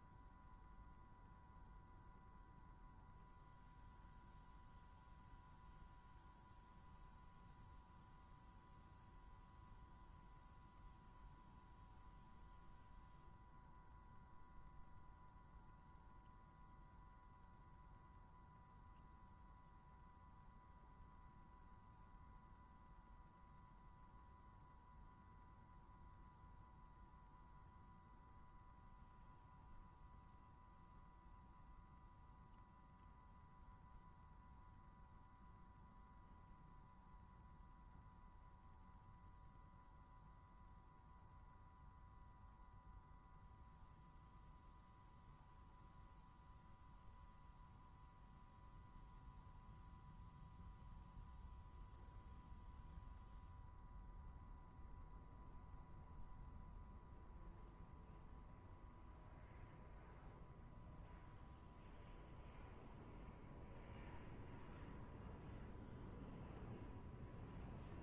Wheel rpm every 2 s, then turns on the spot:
120, 120, 120, 120, 120, 120, 120, 120, 120, 120, 120, 120, 110, 120, 120, 120, 120, 120, 120, 120, 120, 120, 120, 120, 120, 120, 120, 120, 120, 120, 120, 120, 120, 120.
none